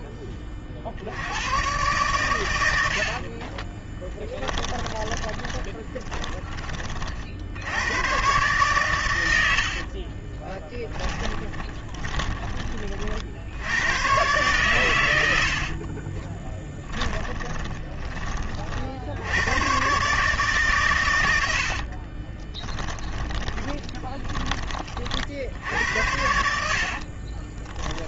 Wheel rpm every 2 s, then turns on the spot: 40, 70, 20, 50, 100, 20, 50, 80, 20, 60, 120, 20, 40, 60.
2-6 10-12 16-18 22-24 26-28